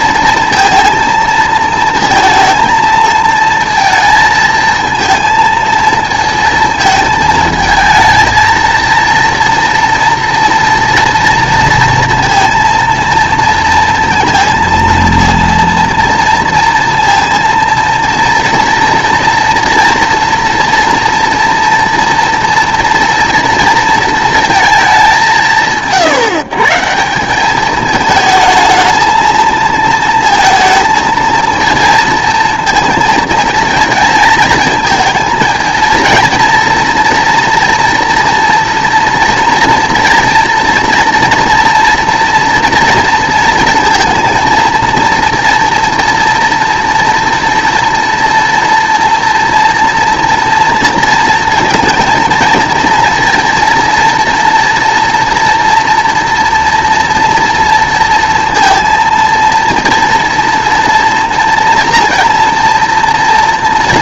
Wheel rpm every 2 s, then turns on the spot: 230, 230, 220, 220, 230, 230, 230, 230, 230, 230, 230, 230, 230, 140, 220, 230, 230, 220, 230, 230, 230, 230, 230, 230, 230, 230, 230, 230, 230, 230, 230, 230.
none